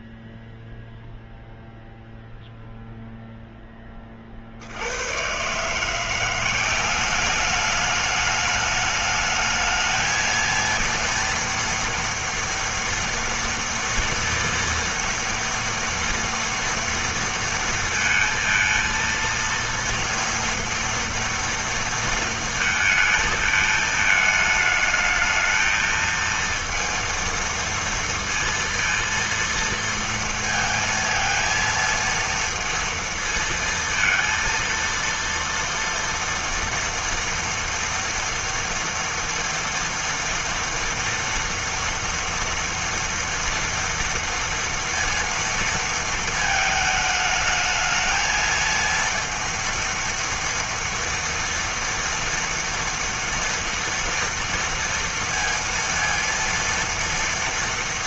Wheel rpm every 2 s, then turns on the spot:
0, 0, 40, 180, 210, 230, 230, 230, 230, 230, 230, 230, 220, 230, 230, 230, 230, 230, 230, 230, 230, 230, 230, 220, 230, 230, 230, 230, 230.
none